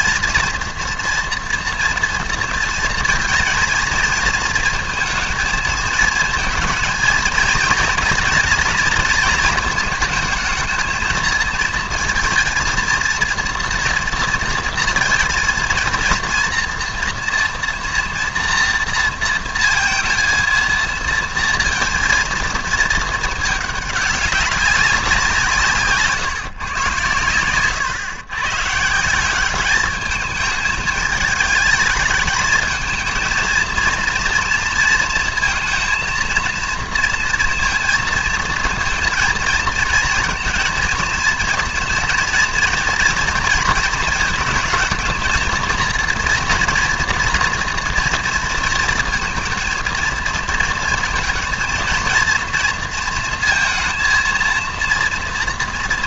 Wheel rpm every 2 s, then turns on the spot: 230, 220, 230, 230, 230, 220, 230, 230, 230, 230, 230, 220, 200, 140, 140, 210, 220, 230, 230, 230, 230, 230, 220, 240, 230, 230, 230, 230.
none